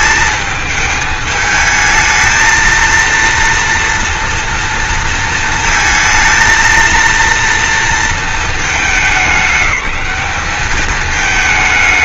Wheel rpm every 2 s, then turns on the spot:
220, 230, 230, 230, 220, 210.
none